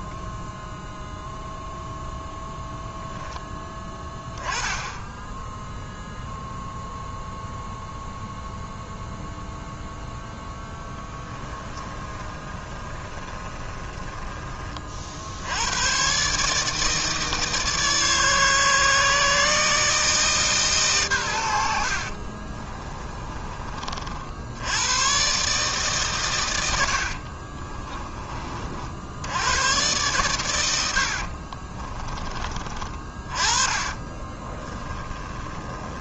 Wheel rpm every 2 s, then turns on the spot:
0, 0, 10, 0, 0, 10, 20, 50, 150, 150, 130, 30, 110, 70, 70, 70, 30, 10.
10-14 22-24 26-28 30-32 34-36